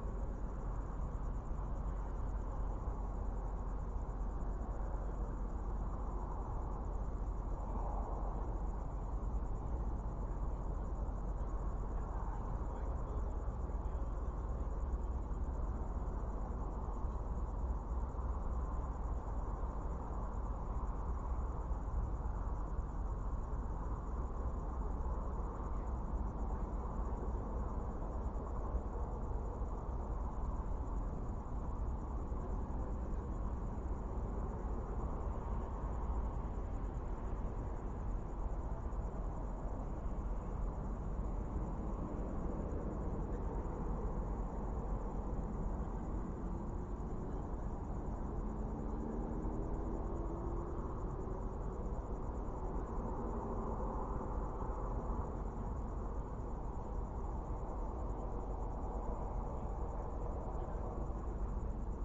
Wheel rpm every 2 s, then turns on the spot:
0, 0, 0, 0, 0, 0, 0, 0, 0, 0, 0, 0, 0, 0, 0, 0, 0, 0, 0, 0, 0, 0, 0, 0, 0, 0, 0, 0, 0, 0, 0.
none